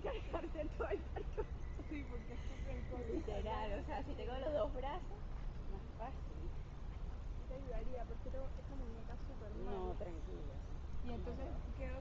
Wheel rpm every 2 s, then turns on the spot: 0, 0, 0, 0, 0, 0.
none